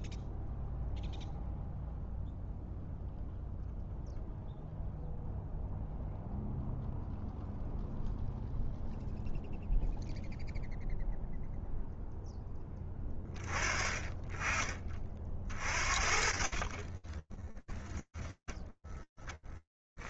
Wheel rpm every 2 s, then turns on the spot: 0, 0, 0, 0, 0, 0, 20, 30, 20, 10.
16-20